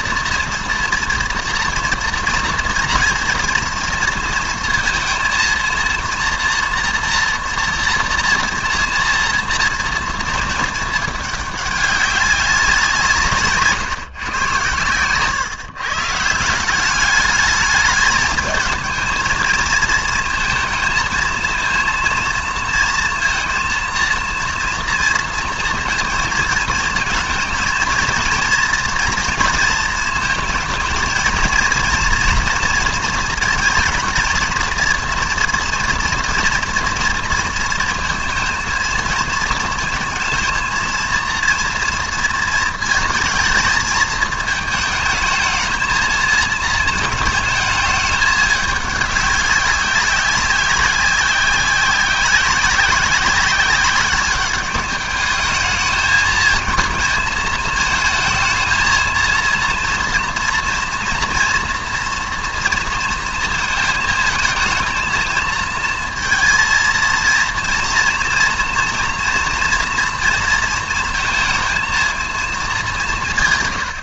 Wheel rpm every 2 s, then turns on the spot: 240, 240, 230, 230, 230, 220, 190, 120, 170, 220, 220, 230, 230, 220, 230, 230, 230, 230, 240, 230, 220, 230, 220, 220, 210, 190, 180, 210, 220, 220, 230, 230, 220, 230, 230, 230, 220.
none